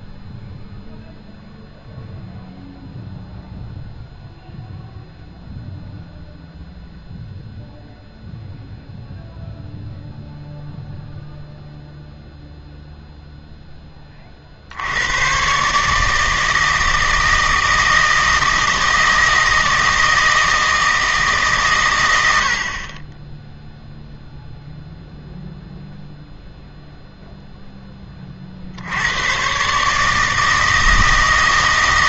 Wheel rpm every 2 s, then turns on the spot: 0, 0, 0, 0, 0, 0, 0, 80, 160, 160, 160, 40, 0, 0, 80, 160.
none